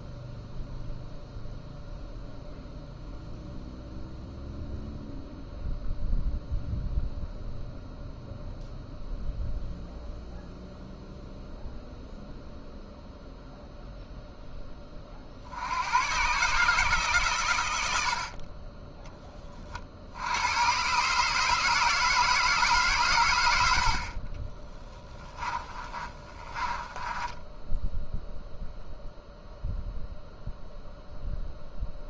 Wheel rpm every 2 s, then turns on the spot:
0, 0, 0, 0, 0, 0, 0, 30, 150, 20, 130, 140, 10, 20, 0, 0.
24-28